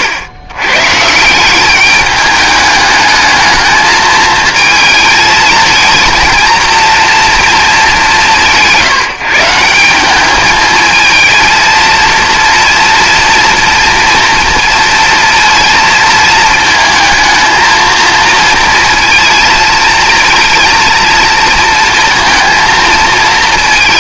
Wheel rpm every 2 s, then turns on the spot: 120, 210, 220, 230, 170, 220, 240, 230, 220, 230, 230, 230.
none